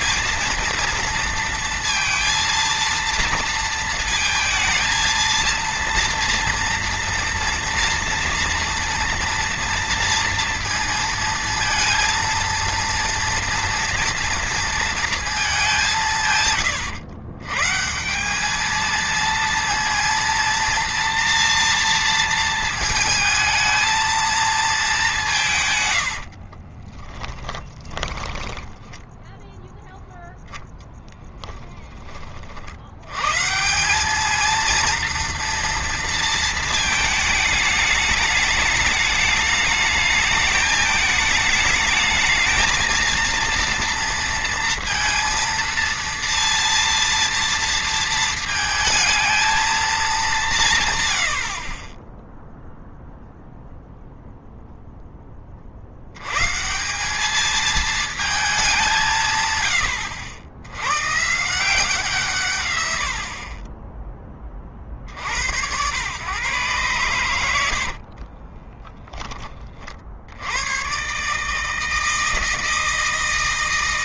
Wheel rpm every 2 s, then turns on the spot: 230, 230, 220, 230, 230, 230, 230, 230, 130, 220, 230, 220, 200, 40, 10, 0, 90, 230, 220, 210, 220, 230, 230, 230, 220, 160, 0, 0, 180, 180, 100, 110, 40, 120, 10, 110, 160.
26-28 68-70